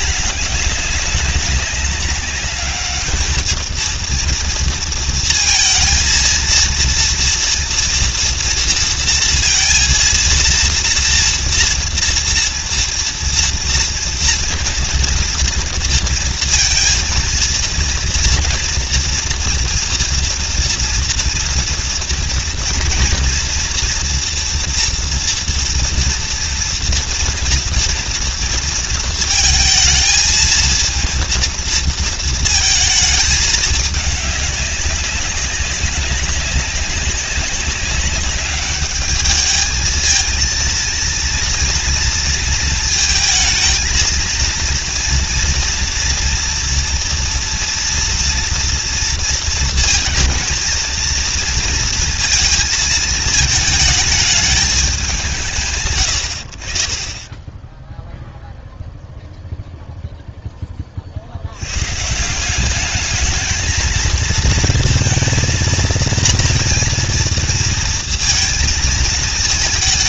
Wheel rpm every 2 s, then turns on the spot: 210, 210, 230, 230, 230, 230, 230, 230, 230, 230, 230, 230, 230, 230, 230, 230, 220, 200, 200, 200, 230, 220, 230, 230, 230, 230, 230, 220, 60, 0, 10, 190, 230, 230, 220.
none